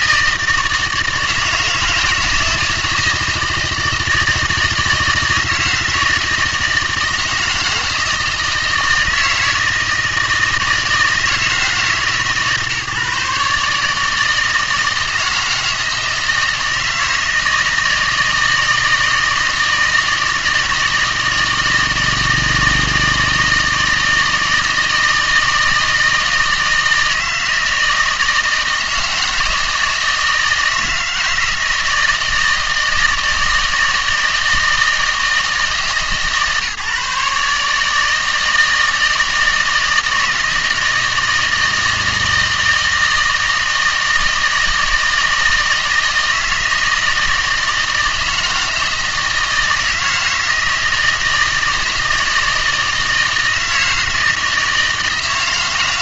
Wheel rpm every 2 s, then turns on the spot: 160, 160, 160, 160, 160, 160, 150, 160, 160, 160, 160, 160, 160, 160, 160, 160, 160, 160, 150, 160, 160, 160, 160, 160, 160, 160, 160, 160.
none